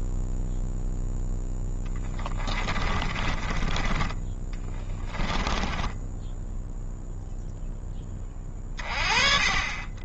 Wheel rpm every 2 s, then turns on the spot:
0, 20, 30, 0, 30.
2-6